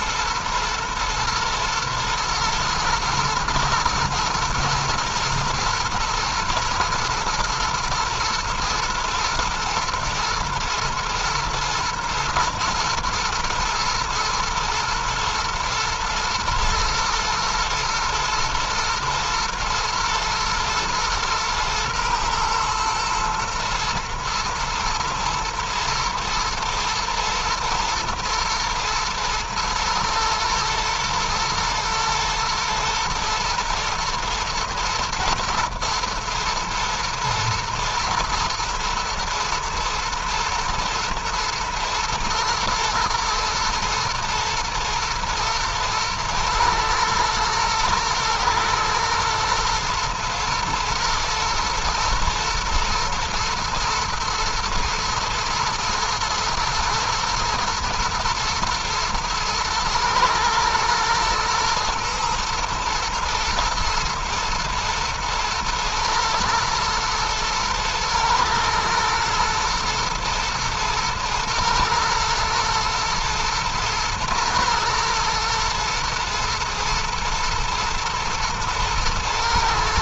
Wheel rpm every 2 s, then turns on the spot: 110, 120, 110, 110, 120, 110, 110, 120, 120, 120, 110, 120, 120, 110, 120, 110, 110, 110, 120, 120, 120, 120, 110, 110, 110, 110, 110, 110, 120, 110, 120, 120, 120, 110, 110, 110, 110, 120, 120, 110.
none